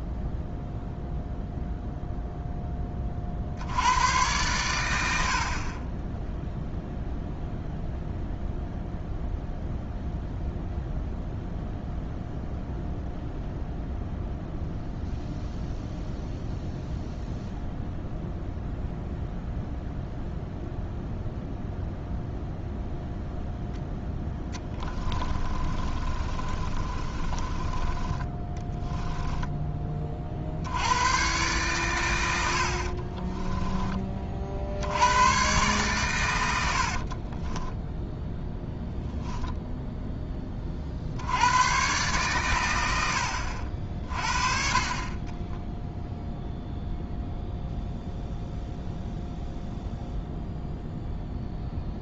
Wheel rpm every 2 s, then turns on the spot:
0, 20, 100, 0, 0, 0, 0, 0, 0, 0, 0, 0, 20, 30, 10, 100, 60, 70, 60, 0, 50, 100, 40, 0, 0, 0.
24-30 32-34 36-38